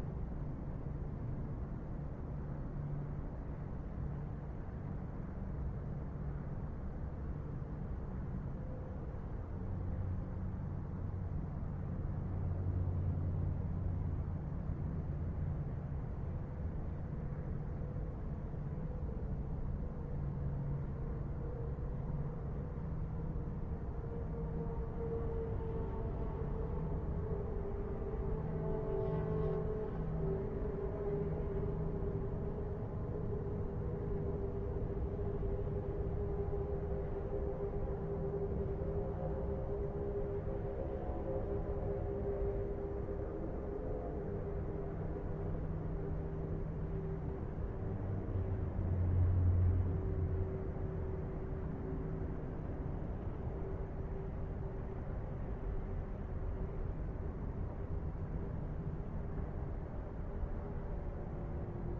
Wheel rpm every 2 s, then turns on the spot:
0, 0, 0, 0, 0, 0, 0, 0, 0, 0, 0, 0, 0, 0, 0, 0, 0, 0, 0, 0, 0, 0, 0, 0, 0, 0, 0, 0, 0, 0, 0.
none